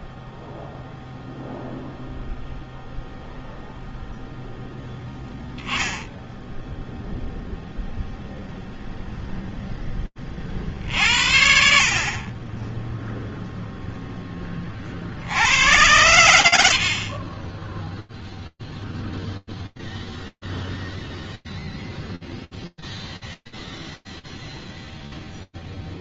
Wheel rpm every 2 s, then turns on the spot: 0, 0, 10, 0, 0, 70, 0, 80, 20, 0, 0, 0, 0.
none